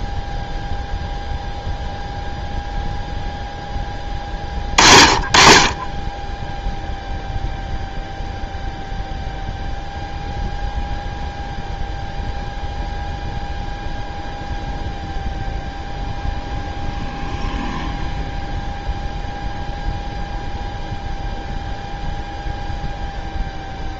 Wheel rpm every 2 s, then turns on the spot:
0, 0, 40, 0, 0, 0, 0, 0, 0, 0, 0, 0.
none